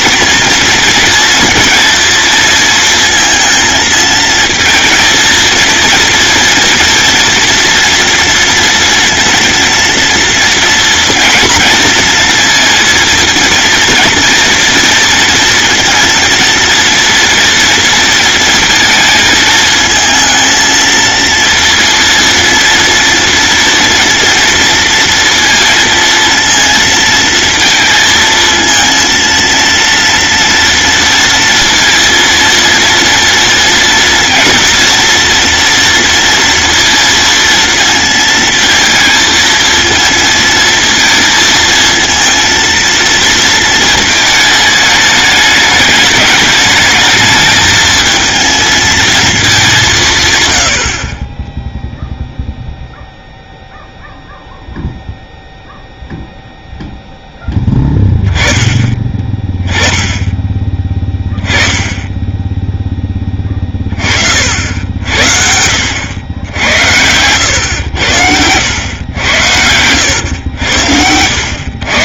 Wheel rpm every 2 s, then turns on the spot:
230, 230, 230, 230, 230, 230, 230, 230, 230, 230, 230, 230, 230, 230, 230, 230, 230, 240, 230, 230, 230, 230, 210, 210, 220, 80, 0, 0, 0, 20, 10, 10, 70, 90, 110, 100.
68-70